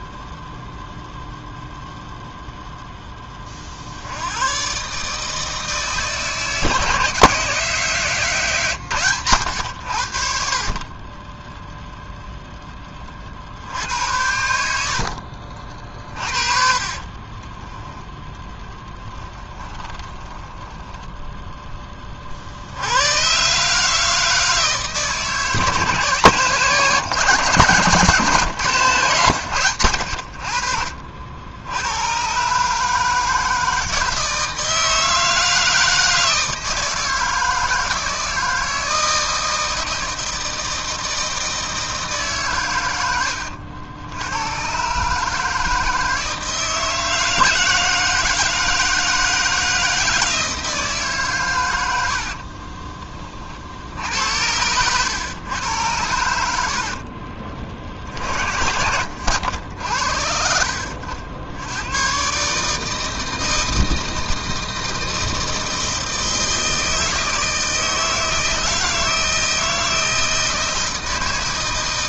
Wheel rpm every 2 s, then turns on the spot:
0, 10, 140, 160, 130, 30, 30, 70, 40, 10, 10, 100, 160, 160, 140, 60, 150, 160, 160, 160, 160, 120, 130, 160, 160, 150, 30, 100, 60, 80, 80, 160, 160, 160, 160, 160.
14-22 56-58